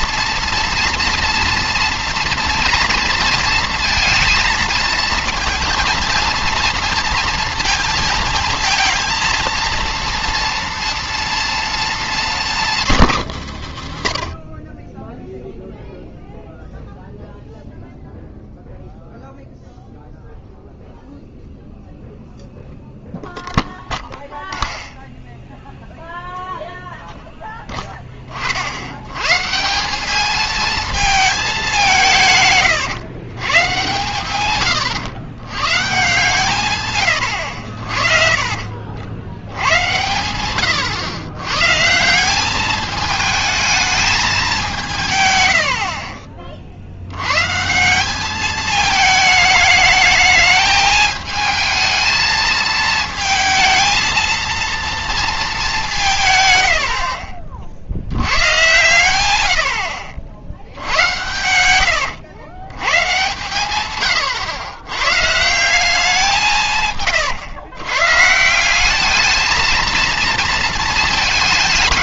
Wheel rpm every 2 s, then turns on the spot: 230, 230, 230, 230, 230, 230, 180, 30, 0, 0, 0, 0, 0, 0, 50, 220, 130, 110, 130, 50, 120, 210, 180, 50, 220, 220, 220, 230, 80, 120, 70, 120, 110, 170, 190, 230.
12-14 32-34